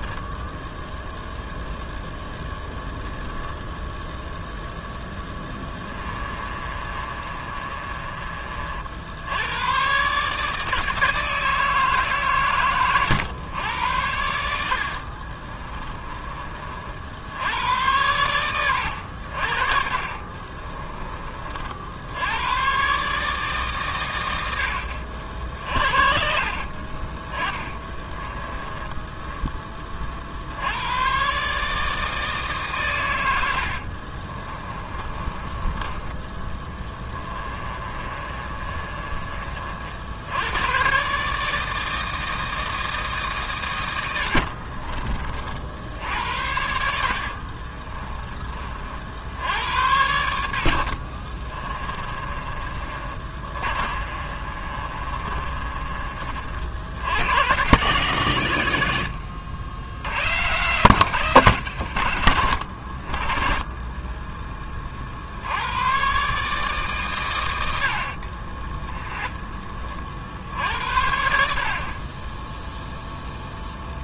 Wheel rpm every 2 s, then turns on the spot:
0, 0, 0, 30, 60, 160, 110, 50, 60, 90, 30, 120, 70, 30, 10, 110, 110, 20, 10, 30, 130, 160, 40, 70, 50, 60, 30, 30, 80, 80, 170, 50, 40, 130, 10, 60, 0.
6-8 14-16 20-22 26-30 34-38 46-48 50-56 68-70